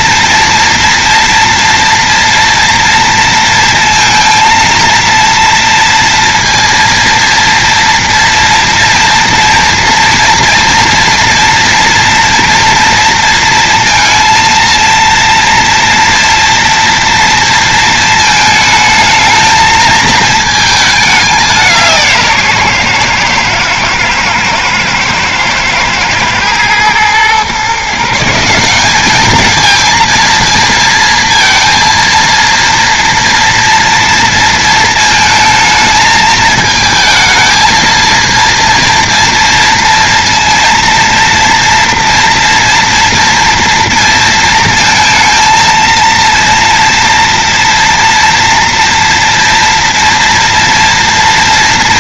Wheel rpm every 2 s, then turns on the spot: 230, 230, 230, 230, 230, 230, 230, 230, 230, 220, 200, 120, 110, 120, 200, 230, 230, 220, 220, 230, 230, 230, 230, 230, 230, 230.
none